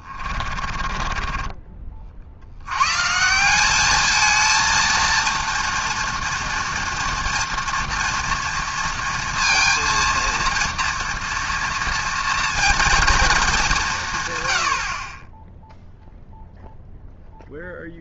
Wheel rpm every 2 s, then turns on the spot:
30, 160, 230, 230, 230, 230, 210, 20, 0.
0-2